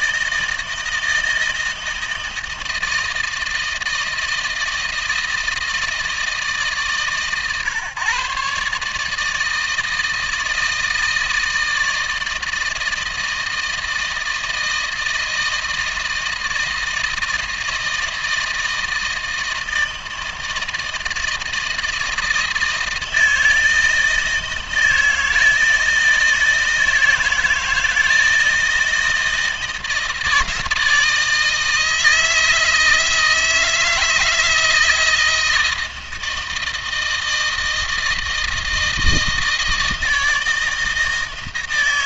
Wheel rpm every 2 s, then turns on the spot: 160, 160, 160, 150, 140, 160, 160, 160, 160, 160, 160, 160, 160, 160, 160, 160, 160, 160, 160, 160, 160.
none